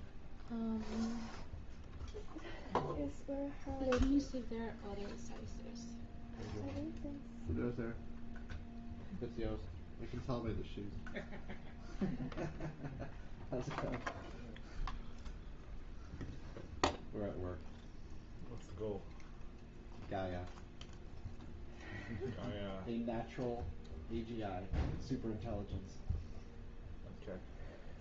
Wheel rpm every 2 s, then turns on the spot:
0, 0, 0, 0, 0, 0, 0, 0, 0, 0, 0, 0, 0, 0.
none